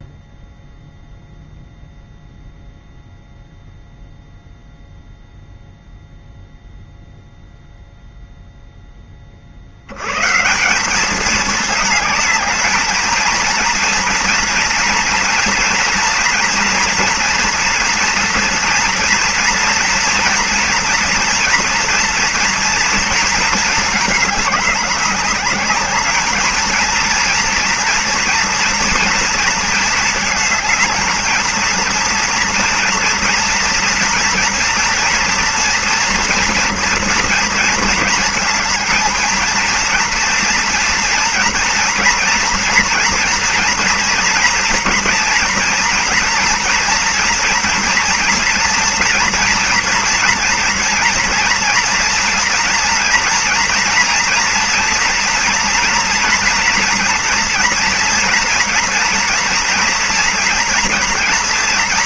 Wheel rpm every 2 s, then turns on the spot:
0, 0, 0, 0, 0, 140, 220, 230, 230, 230, 230, 240, 210, 220, 230, 220, 230, 230, 230, 220, 230, 240, 230, 240, 240, 230, 230, 240, 230, 230, 240.
none